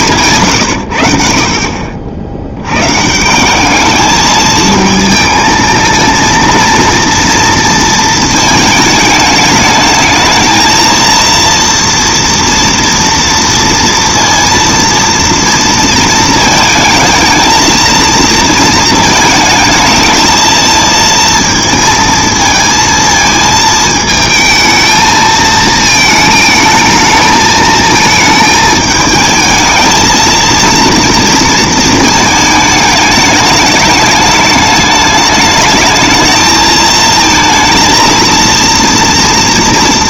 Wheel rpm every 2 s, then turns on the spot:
40, 210, 230, 230, 220, 230, 230, 230, 220, 220, 220, 220, 220, 220, 220, 220, 210, 210, 230, 230.
none